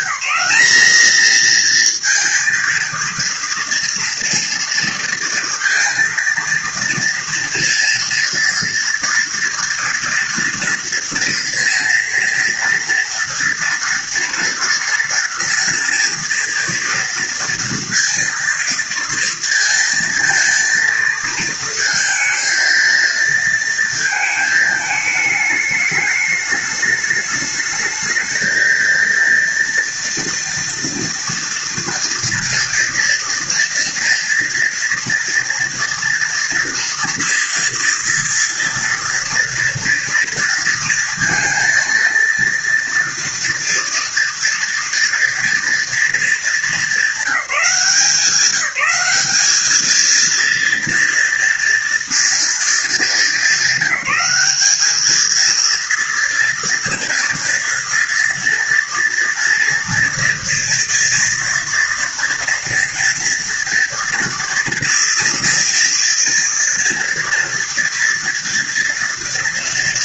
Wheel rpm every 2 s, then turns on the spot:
230, 230, 230, 230, 230, 230, 230, 230, 230, 230, 220, 230, 210, 210, 230, 230, 230, 230, 230, 230, 230, 240, 240, 190, 200, 230, 210, 230, 230, 230, 230, 240, 230, 230, 230.
none